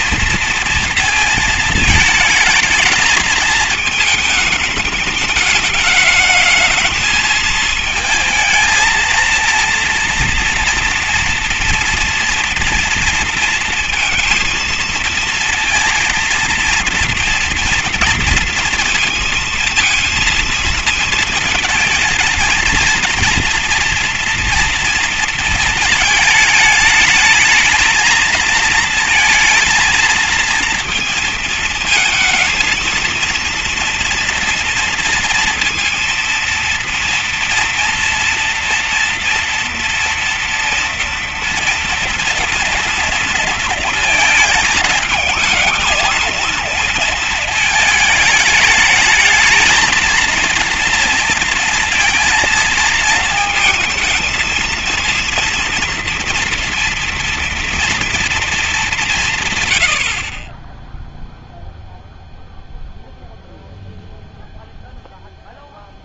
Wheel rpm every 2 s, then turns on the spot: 230, 220, 220, 220, 220, 230, 230, 230, 230, 230, 230, 220, 240, 220, 220, 230, 230, 230, 230, 230, 230, 230, 220, 220, 220, 230, 230, 220, 230, 220, 30, 0, 0.
none